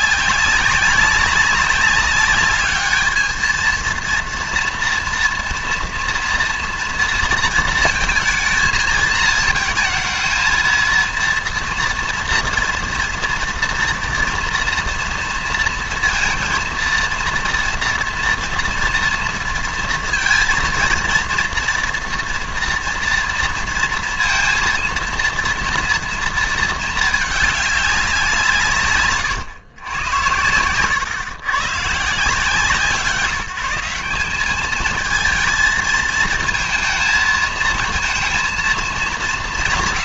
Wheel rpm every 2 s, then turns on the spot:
200, 210, 230, 230, 230, 230, 240, 230, 230, 230, 230, 230, 230, 220, 150, 110, 160, 210, 220, 230.
none